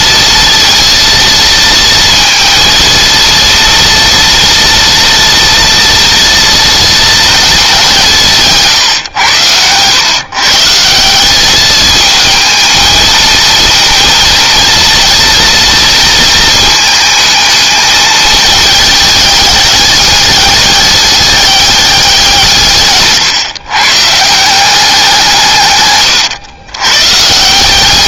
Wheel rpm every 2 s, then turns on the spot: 230, 230, 230, 230, 140, 150, 220, 230, 220, 210, 200, 160, 190, 120.
none